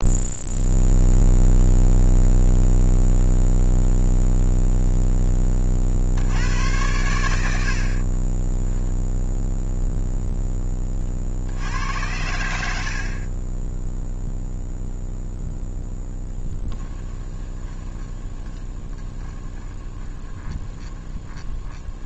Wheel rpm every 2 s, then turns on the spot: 0, 0, 0, 90, 20, 10, 70, 0, 10, 20, 20.
8-10 16-22